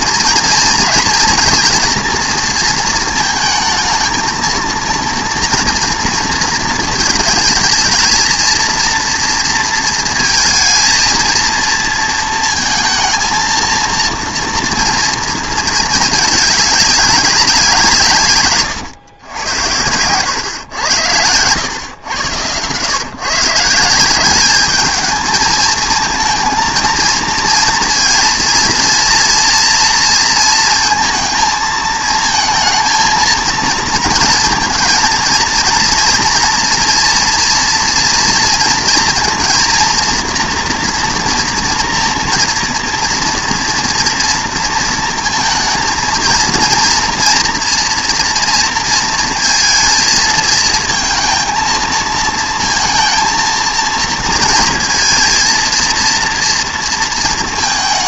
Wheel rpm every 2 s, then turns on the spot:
230, 230, 230, 220, 230, 230, 230, 230, 200, 120, 100, 120, 210, 230, 230, 230, 230, 230, 230, 230, 230, 230, 230, 230, 230, 220, 230, 230, 240.
none